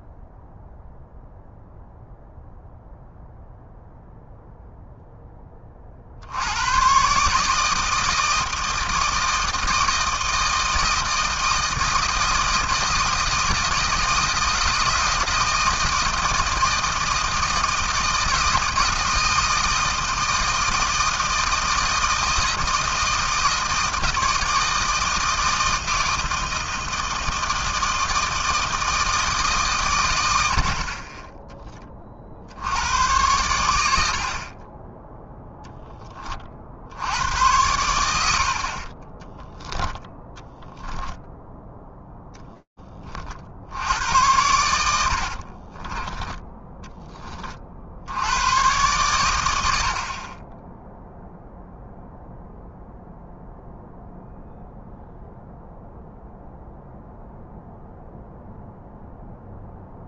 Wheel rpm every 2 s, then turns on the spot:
0, 0, 0, 80, 160, 160, 160, 160, 160, 160, 160, 160, 160, 170, 160, 70, 70, 40, 40, 70, 10, 10, 90, 10, 110, 10, 0, 0, 0, 0.
40-42 44-46